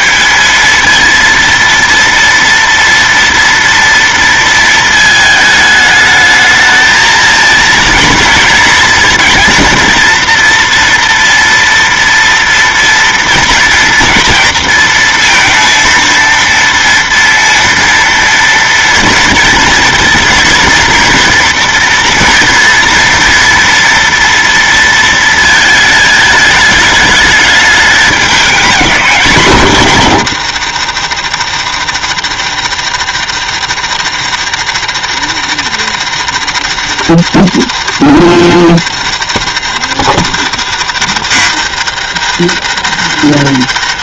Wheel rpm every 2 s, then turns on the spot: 220, 230, 230, 220, 230, 230, 230, 230, 230, 230, 230, 230, 230, 220, 230, 190, 170, 170, 170, 170, 170, 170.
none